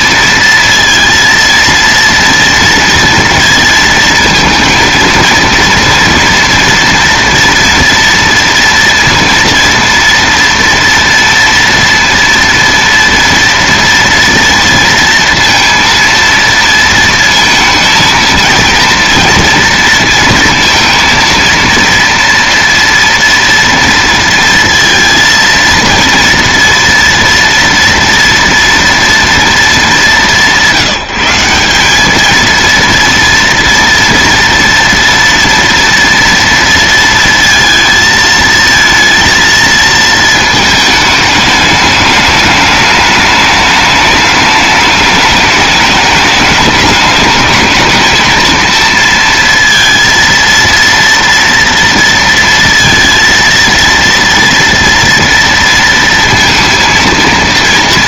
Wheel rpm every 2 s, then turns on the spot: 230, 230, 230, 230, 230, 230, 230, 230, 230, 230, 230, 230, 230, 230, 240, 180, 230, 230, 230, 230, 220, 210, 210, 210, 230, 230, 230, 230, 230.
none